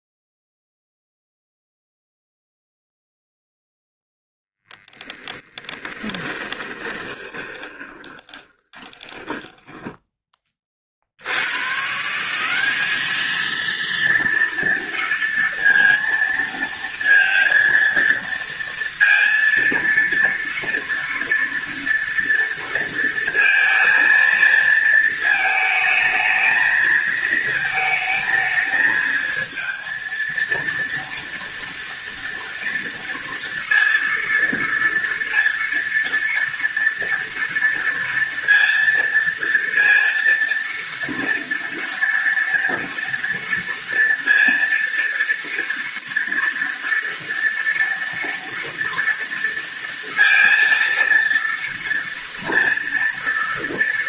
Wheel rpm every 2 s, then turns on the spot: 0, 0, 0, 20, 20, 40, 200, 230, 230, 230, 230, 230, 230, 220, 220, 230, 230, 230, 230, 230, 230, 230, 230, 230, 230, 230, 230.
6-10